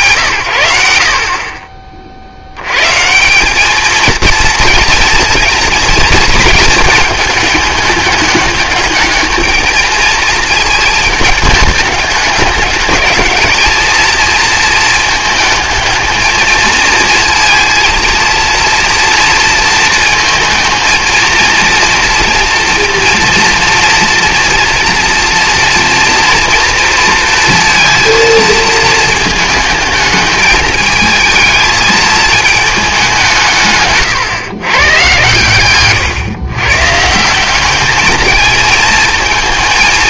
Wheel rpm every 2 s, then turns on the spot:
100, 110, 230, 220, 210, 220, 210, 230, 230, 230, 220, 230, 230, 230, 220, 220, 220, 130, 120, 220.
none